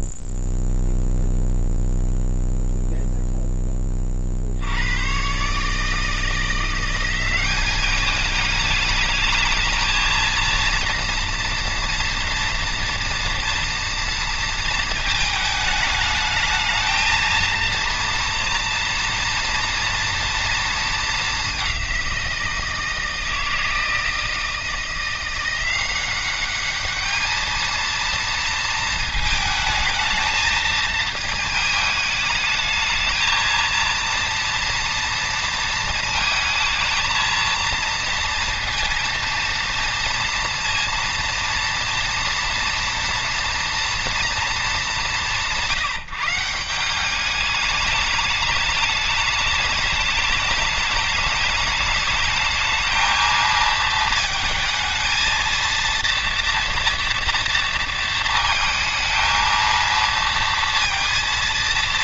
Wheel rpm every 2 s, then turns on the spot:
0, 0, 80, 170, 210, 230, 230, 230, 220, 230, 230, 170, 170, 210, 220, 220, 220, 230, 230, 230, 230, 230, 190, 180, 210, 210, 220, 220, 230, 220, 230.
none